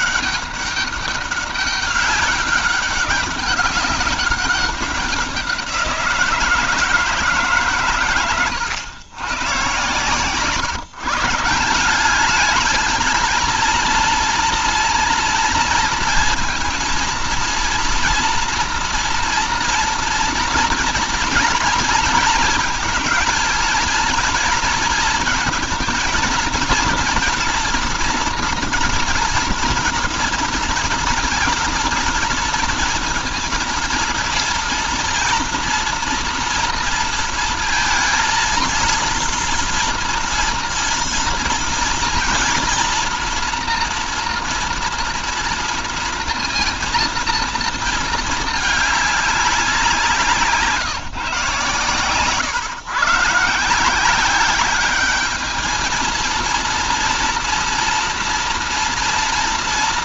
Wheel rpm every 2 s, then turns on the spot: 200, 200, 190, 160, 110, 130, 220, 230, 230, 230, 230, 230, 220, 230, 230, 230, 230, 230, 230, 230, 240, 230, 230, 230, 210, 160, 140, 200, 230, 240.
none